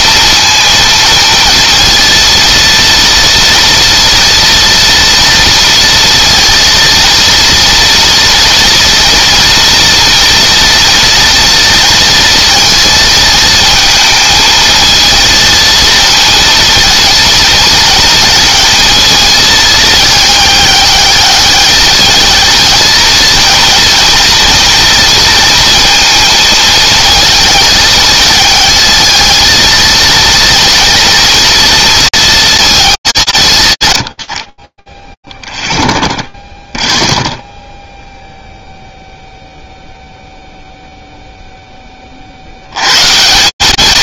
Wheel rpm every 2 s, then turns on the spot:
230, 230, 230, 230, 230, 230, 230, 220, 230, 230, 210, 230, 230, 220, 220, 230, 200, 20, 0, 0, 0, 150.
none